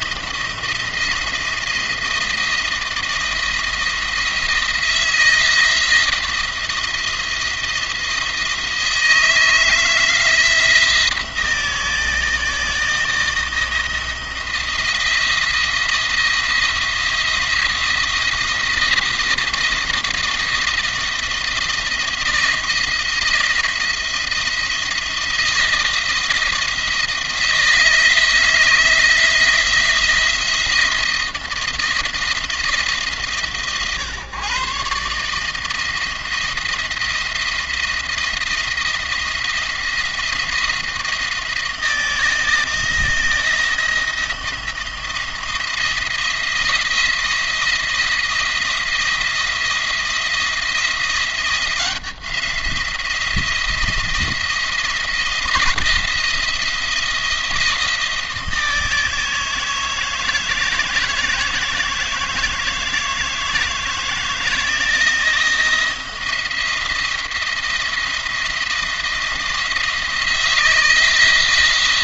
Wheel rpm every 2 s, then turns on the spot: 170, 170, 170, 170, 160, 160, 160, 170, 170, 170, 170, 170, 170, 170, 160, 170, 160, 140, 170, 170, 170, 160, 170, 170, 170, 170, 170, 170, 170, 160, 160, 160, 170, 170, 170, 170.
none